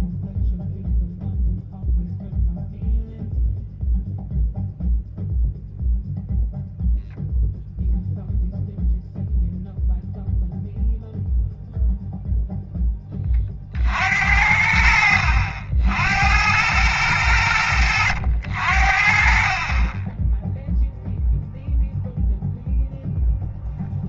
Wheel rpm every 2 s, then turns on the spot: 0, 0, 0, 0, 0, 0, 10, 70, 100, 60, 0, 0.
none